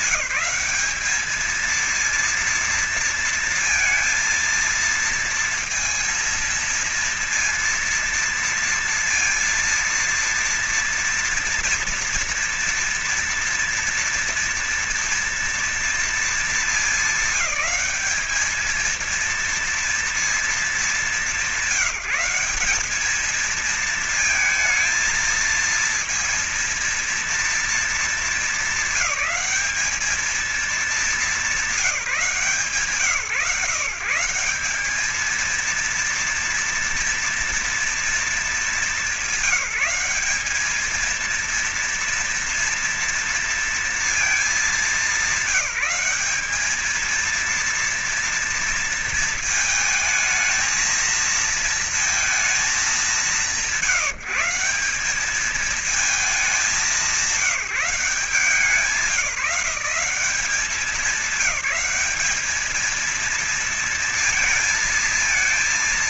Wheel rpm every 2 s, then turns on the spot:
210, 230, 230, 230, 230, 230, 230, 230, 220, 220, 220, 210, 220, 230, 200, 210, 140, 180, 230, 210, 210, 230, 210, 210, 230, 220, 210, 190, 200, 170, 190, 220, 230.
none